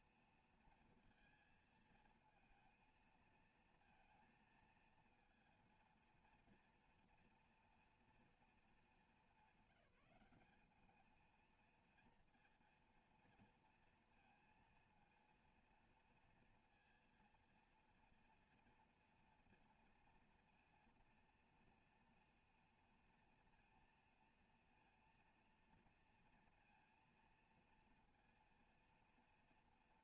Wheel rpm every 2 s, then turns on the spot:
230, 230, 230, 240, 220, 200, 230, 230, 230, 230, 230, 230, 230, 230, 230.
none